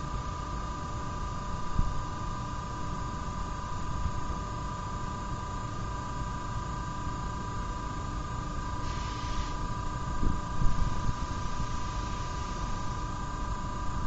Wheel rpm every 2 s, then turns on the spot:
0, 0, 0, 0, 0, 0, 0.
none